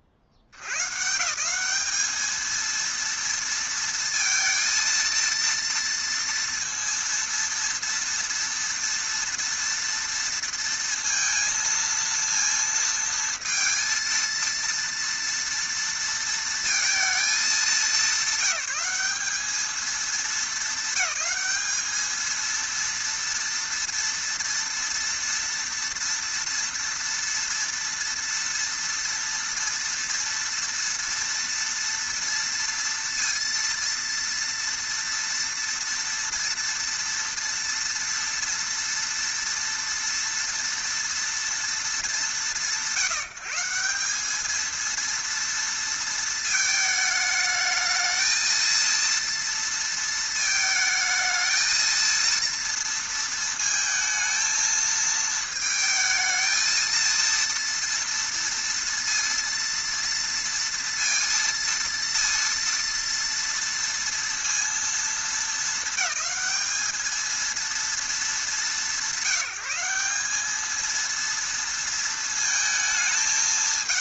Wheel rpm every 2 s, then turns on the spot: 70, 230, 230, 230, 230, 230, 230, 230, 230, 200, 220, 230, 230, 230, 230, 230, 230, 230, 230, 230, 230, 160, 220, 220, 230, 220, 230, 220, 230, 230, 230, 230, 230, 220, 180, 220, 220.
none